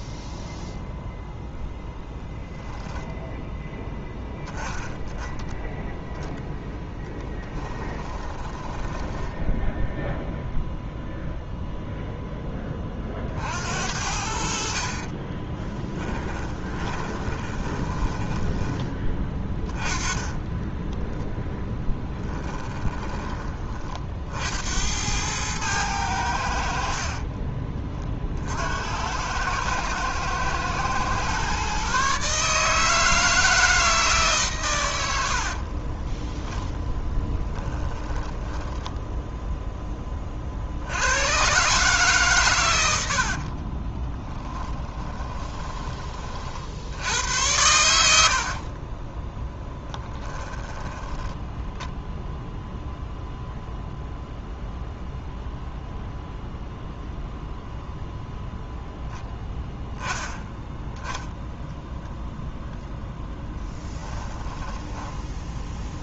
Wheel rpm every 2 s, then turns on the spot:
0, 0, 0, 10, 10, 0, 20, 50, 20, 20, 10, 10, 70, 70, 60, 110, 150, 120, 10, 10, 70, 100, 10, 70, 30, 20, 0, 0, 0, 0, 0, 10, 10.
6-10 16-24 44-46 48-52 64-66